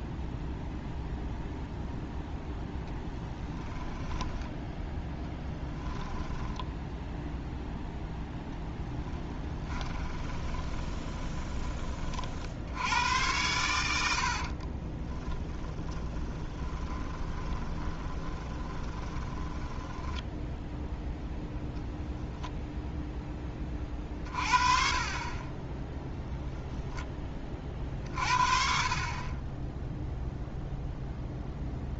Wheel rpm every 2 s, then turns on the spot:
0, 0, 10, 20, 10, 20, 80, 40, 20, 20, 0, 0, 30, 10, 40, 0.
10-12 14-20